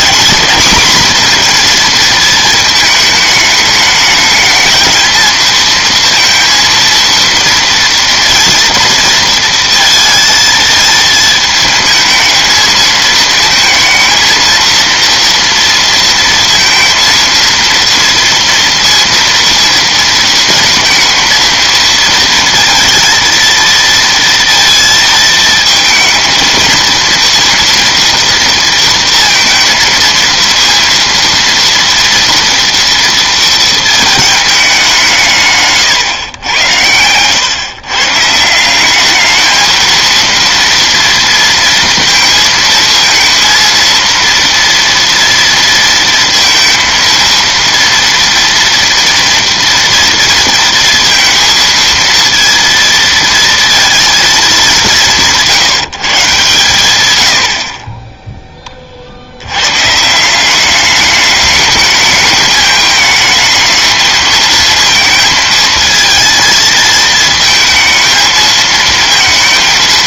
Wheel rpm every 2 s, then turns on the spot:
230, 220, 220, 230, 230, 220, 220, 230, 230, 230, 230, 230, 230, 230, 230, 230, 230, 200, 120, 180, 230, 230, 230, 230, 230, 230, 230, 200, 130, 20, 190, 220, 230, 220, 220.
none